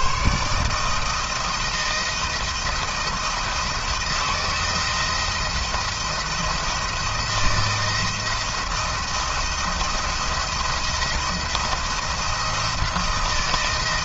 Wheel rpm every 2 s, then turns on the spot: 160, 170, 160, 170, 170, 170, 170.
none